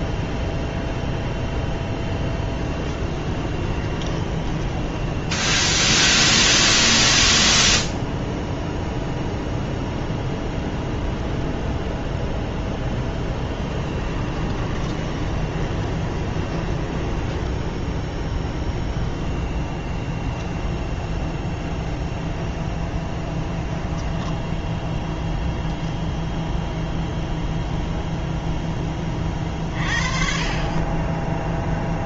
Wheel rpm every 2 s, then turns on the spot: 0, 20, 10, 10, 0, 0, 0, 20, 20, 0, 10, 20, 10, 0, 10, 30.
2-6 14-18 22-24